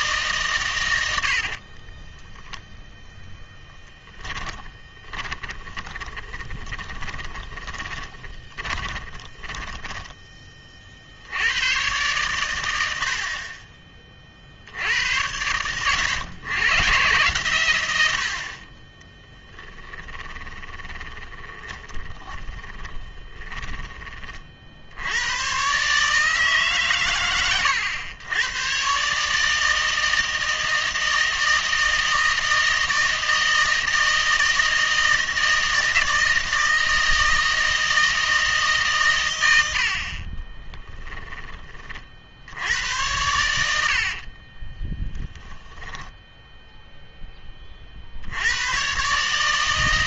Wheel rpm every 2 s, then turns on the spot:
100, 0, 20, 20, 10, 40, 90, 90, 120, 20, 20, 20, 70, 130, 130, 160, 160, 160, 160, 140, 20, 90, 30, 0, 120.
4-10 20-24 40-42 44-46